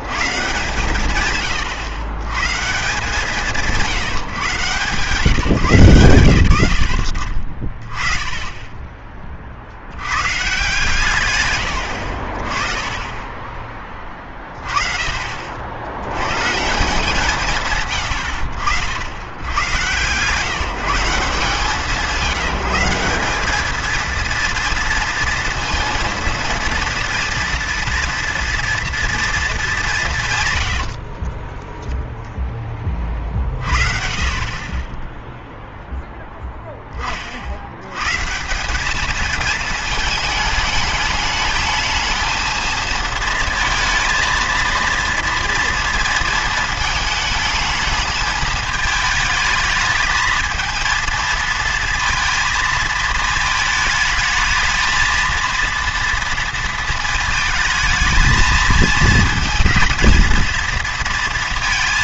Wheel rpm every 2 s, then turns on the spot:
140, 150, 140, 90, 20, 140, 30, 30, 150, 70, 170, 180, 230, 230, 230, 100, 20, 20, 10, 200, 220, 230, 230, 220, 220, 230, 230, 220, 230, 220, 230.
30-32